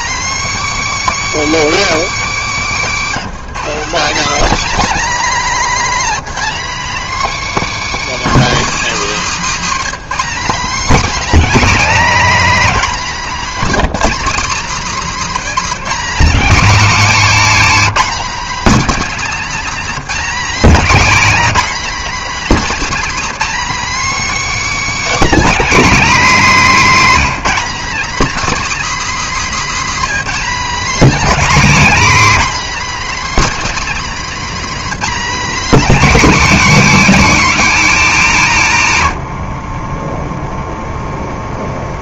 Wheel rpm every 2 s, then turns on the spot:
310, 260, 270, 280, 290, 260, 270, 260, 260, 280, 270, 280, 310, 280, 280, 280, 300, 290, 270, 170, 0.
none